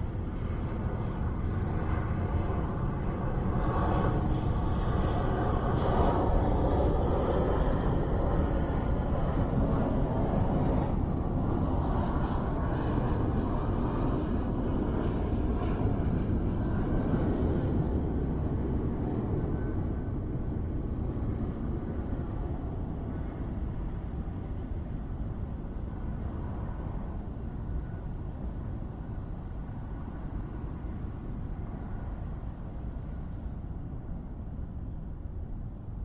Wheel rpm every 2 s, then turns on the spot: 0, 0, 0, 0, 0, 0, 0, 0, 0, 0, 0, 0, 0, 0, 0, 0, 0, 0.
none